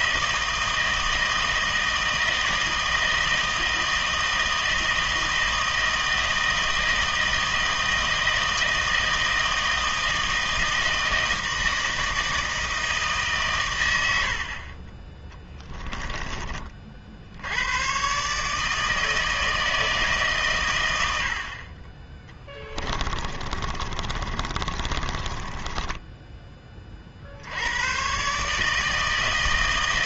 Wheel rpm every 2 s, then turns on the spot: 160, 160, 160, 160, 160, 160, 160, 40, 40, 150, 110, 20, 30, 40, 160.
22-26